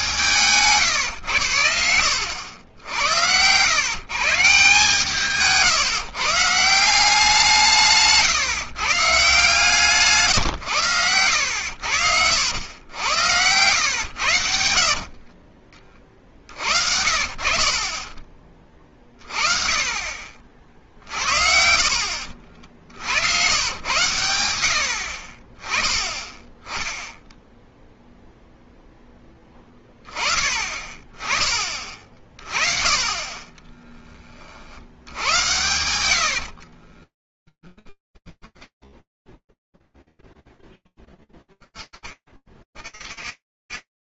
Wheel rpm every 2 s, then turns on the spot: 140, 90, 150, 170, 170, 120, 80, 70, 50, 40, 50, 50, 100, 10, 0, 30, 30, 50, 50, 10, 10, 40.
2-4 14-16 24-26 36-40